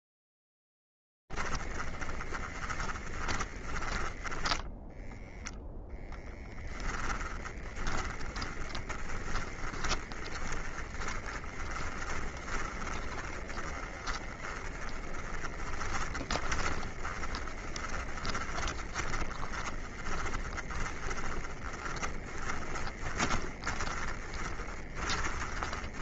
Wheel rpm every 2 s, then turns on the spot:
0, 10, 20, 10, 20, 20, 20, 30, 20, 20, 20, 20, 20.
2-6 8-26